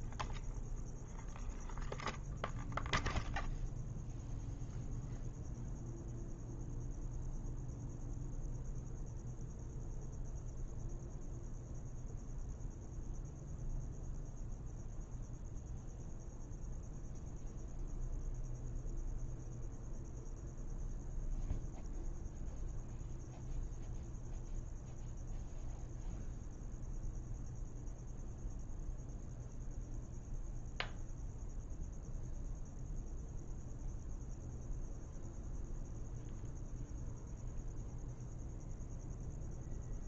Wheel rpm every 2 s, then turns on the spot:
0, 0, 0, 0, 0, 0, 0, 0, 0, 0, 0, 0, 0, 0, 0, 0, 0, 0, 0, 0.
none